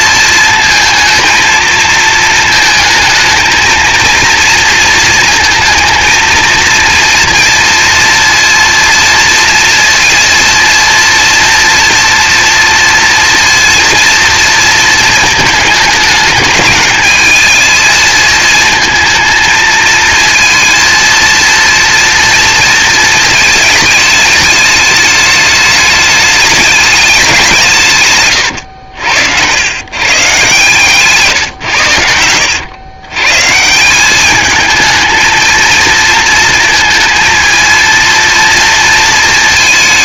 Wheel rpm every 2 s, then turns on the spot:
230, 220, 230, 230, 230, 230, 230, 220, 210, 230, 230, 230, 210, 210, 100, 140, 110, 220, 220, 230.
none